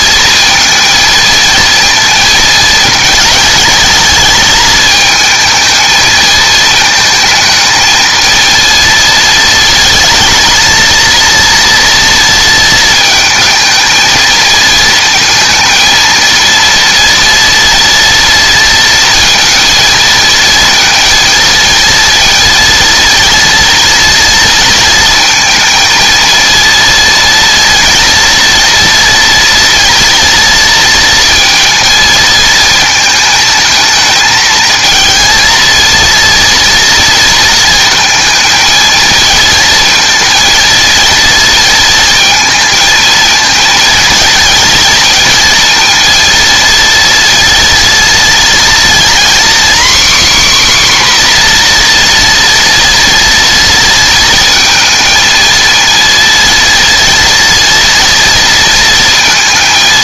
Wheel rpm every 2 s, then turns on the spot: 230, 230, 220, 220, 230, 230, 230, 220, 230, 230, 230, 230, 230, 230, 230, 230, 230, 230, 230, 220, 230, 230, 230, 230, 230, 270, 230, 220, 230, 230.
none